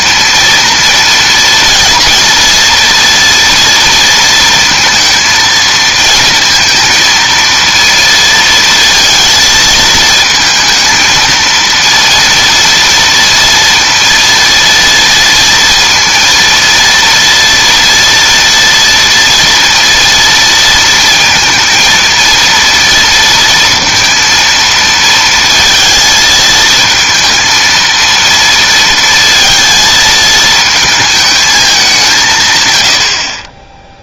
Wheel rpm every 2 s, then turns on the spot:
230, 230, 230, 230, 220, 230, 230, 230, 230, 230, 230, 230, 230, 220, 230, 220, 110.
none